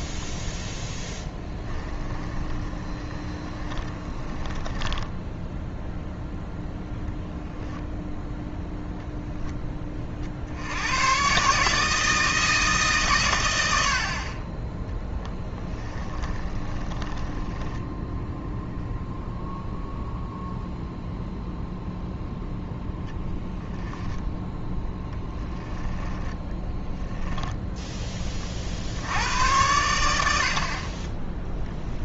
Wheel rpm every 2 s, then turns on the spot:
0, 20, 10, 0, 0, 90, 150, 10, 20, 0, 0, 10, 10, 10, 70, 40.
2-6 16-18 24-28